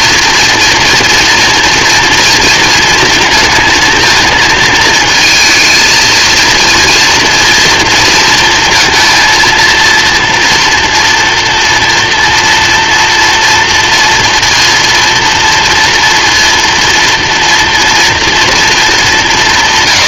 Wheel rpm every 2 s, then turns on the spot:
240, 230, 220, 230, 230, 230, 230, 230, 230, 220.
none